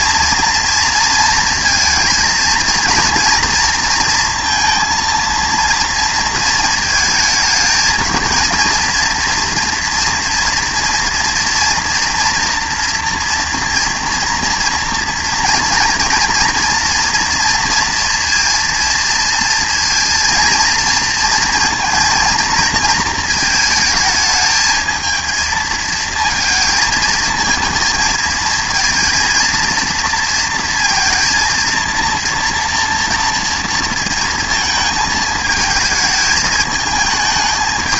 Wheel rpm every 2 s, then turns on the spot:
230, 220, 230, 230, 230, 230, 230, 230, 240, 230, 230, 230, 220, 220, 230, 230, 230, 220, 210.
none